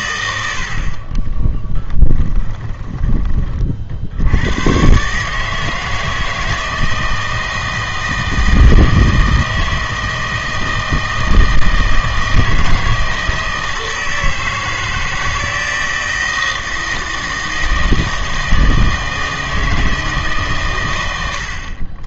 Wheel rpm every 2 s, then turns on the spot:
70, 20, 120, 160, 160, 160, 160, 160, 160, 160, 120.
2-4